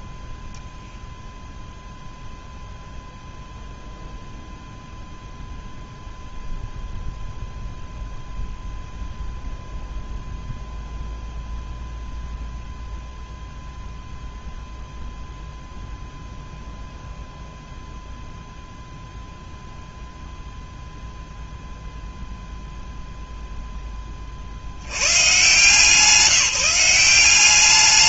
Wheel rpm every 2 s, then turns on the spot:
0, 0, 0, 0, 0, 0, 0, 0, 0, 0, 0, 0, 20, 170.
none